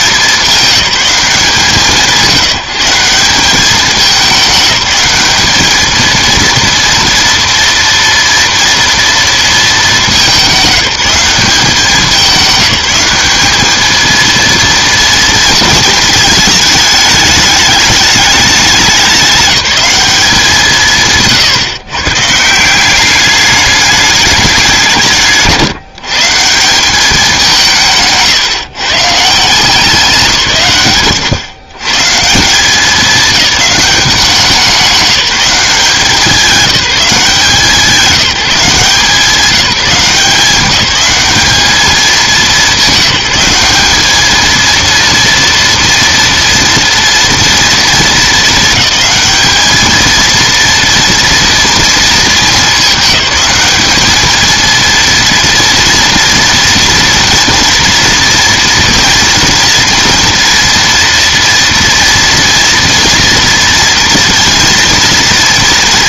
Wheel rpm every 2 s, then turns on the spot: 210, 170, 190, 230, 230, 200, 190, 230, 220, 190, 160, 180, 190, 190, 150, 140, 190, 180, 190, 180, 190, 200, 230, 230, 210, 230, 220, 230, 230, 230, 230, 230, 230.
none